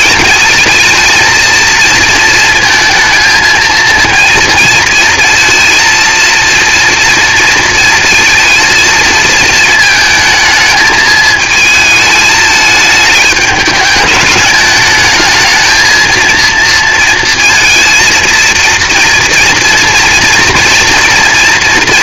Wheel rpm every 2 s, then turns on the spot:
220, 230, 230, 230, 230, 220, 210, 210, 230, 230, 230.
none